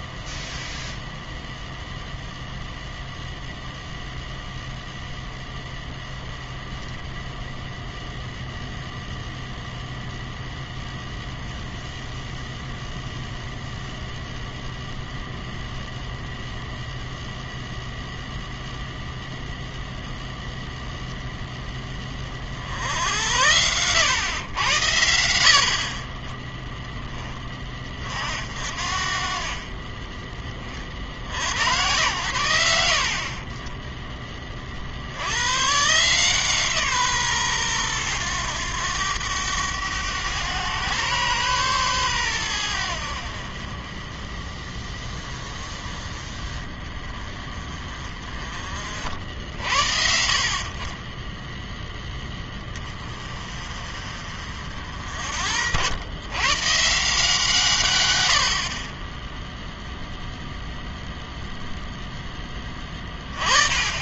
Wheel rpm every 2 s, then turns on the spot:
0, 0, 0, 0, 0, 0, 0, 0, 0, 0, 0, 70, 100, 10, 50, 40, 70, 40, 150, 100, 120, 90, 30, 20, 30, 50, 20, 50, 150, 50, 0, 10.
none